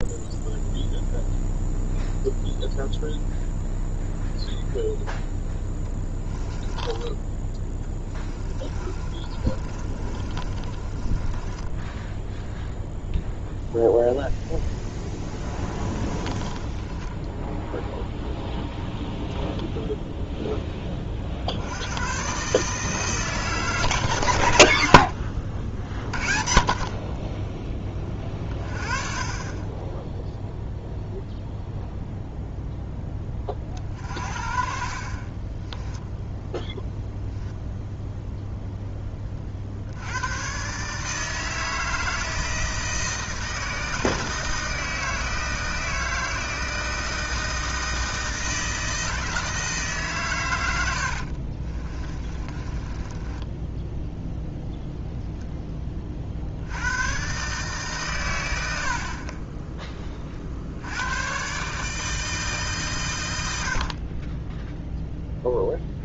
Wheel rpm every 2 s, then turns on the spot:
0, 0, 0, 10, 20, 30, 0, 10, 20, 10, 10, 150, 100, 40, 20, 0, 0, 40, 0, 0, 130, 160, 160, 160, 160, 100, 20, 0, 80, 80, 70, 150, 10.
6-12 16-18 52-54